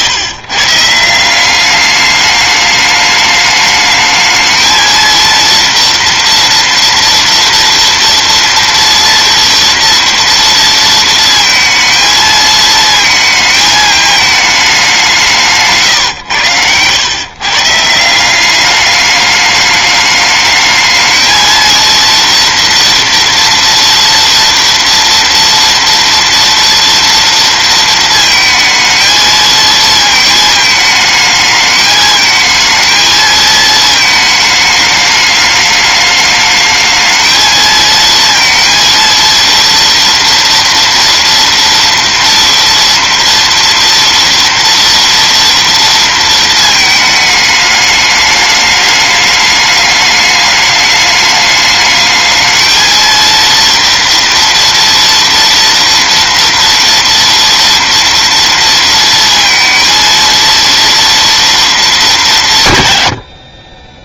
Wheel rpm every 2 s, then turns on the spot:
130, 210, 220, 230, 230, 230, 220, 220, 120, 180, 210, 230, 230, 230, 220, 220, 220, 220, 210, 230, 240, 230, 230, 230, 210, 210, 220, 230, 230, 230, 230, 190.
none